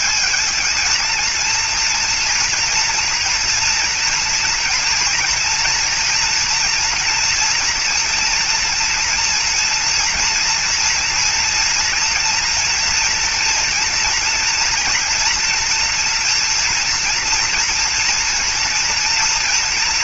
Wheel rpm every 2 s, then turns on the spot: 220, 230, 230, 230, 230, 230, 230, 230, 230, 230.
none